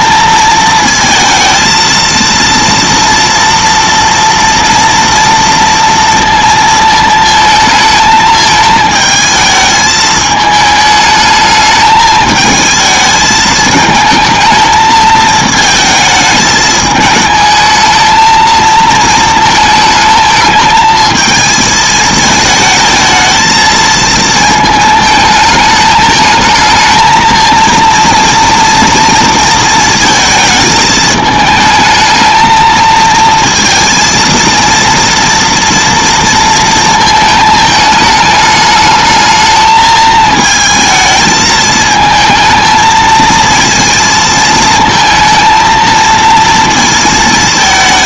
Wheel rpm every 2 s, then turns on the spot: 230, 230, 230, 230, 220, 210, 220, 220, 210, 230, 220, 220, 220, 220, 230, 220, 220, 230, 230, 220, 220, 220, 230, 230.
none